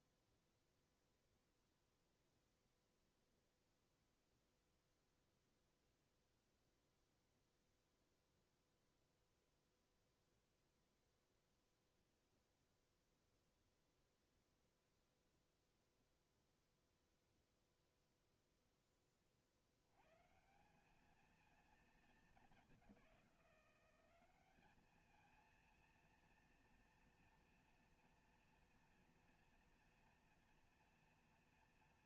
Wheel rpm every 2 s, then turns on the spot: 0, 0, 0, 0, 0, 0, 0, 0, 0, 20, 220, 190, 220, 230, 230, 230.
none